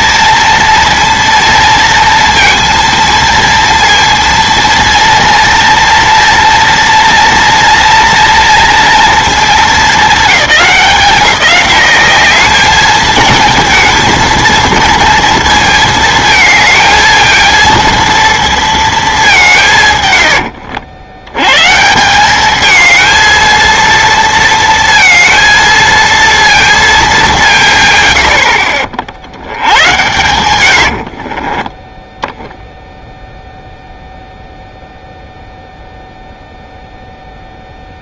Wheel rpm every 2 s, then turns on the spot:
230, 230, 230, 230, 230, 210, 200, 230, 220, 230, 110, 180, 230, 230, 90, 110, 10, 0, 0.
30-32